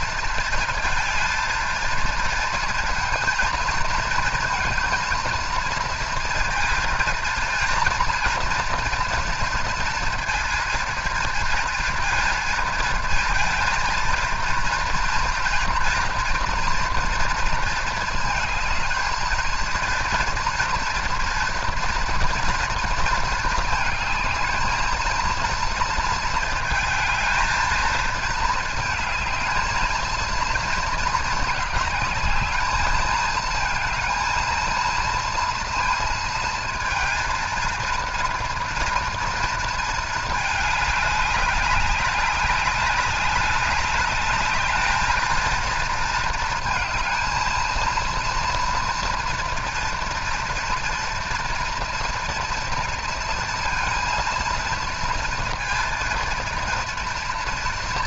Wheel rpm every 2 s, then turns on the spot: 230, 230, 230, 230, 230, 230, 230, 230, 230, 220, 230, 230, 220, 220, 220, 230, 220, 230, 230, 230, 210, 200, 210, 220, 230, 240, 230, 230, 230.
none